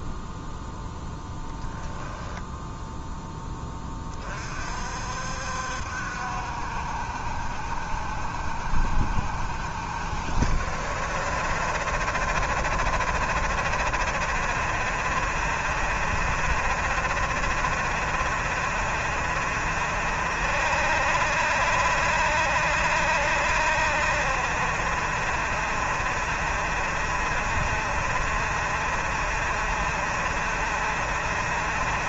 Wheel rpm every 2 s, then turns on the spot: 0, 10, 60, 70, 70, 60, 70, 60, 70, 70, 70, 70, 70, 70, 70, 70.
none